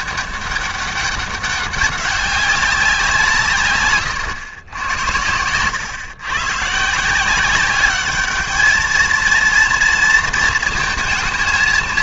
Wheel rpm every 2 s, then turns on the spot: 200, 190, 120, 140, 220, 230.
none